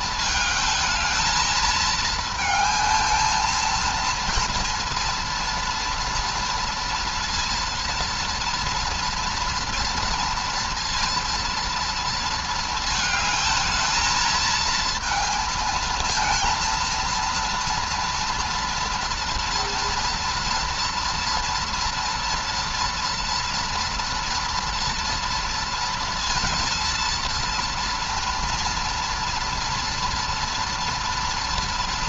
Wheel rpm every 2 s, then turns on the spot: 220, 220, 230, 230, 230, 230, 220, 230, 230, 230, 230, 230, 230, 230, 230, 230.
none